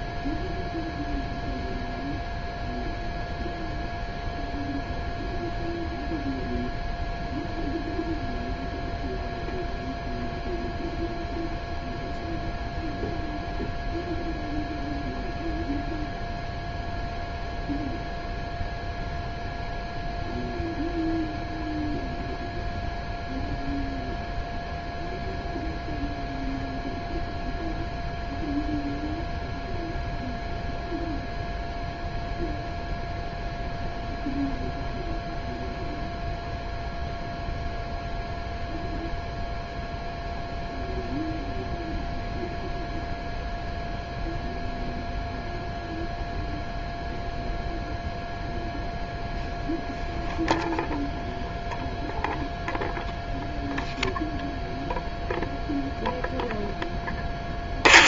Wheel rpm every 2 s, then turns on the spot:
0, 0, 0, 0, 0, 0, 0, 0, 0, 0, 0, 0, 0, 0, 0, 0, 0, 0, 0, 0, 0, 0, 0, 0, 0, 0, 0, 0, 10.
none